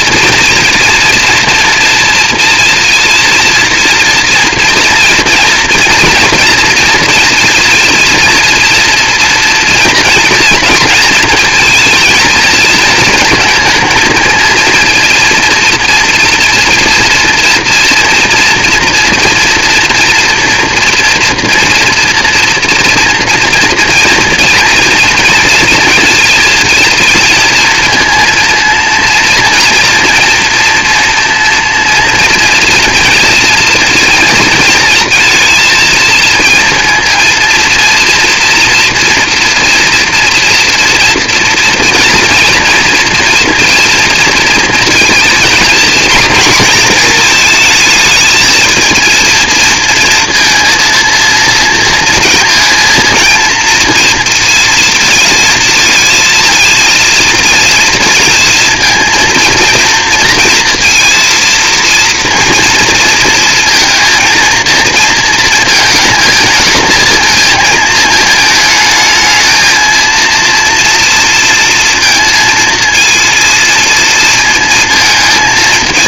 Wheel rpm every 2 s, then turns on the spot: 230, 230, 230, 230, 230, 230, 230, 230, 230, 230, 240, 230, 230, 230, 230, 230, 230, 220, 230, 240, 230, 230, 230, 240, 220, 230, 230, 230, 230, 230, 230, 230, 230, 220, 220, 230, 230, 220.
none